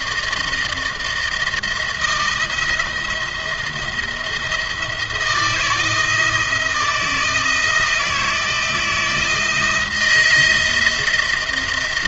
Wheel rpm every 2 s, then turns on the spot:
160, 170, 170, 160, 160, 170.
none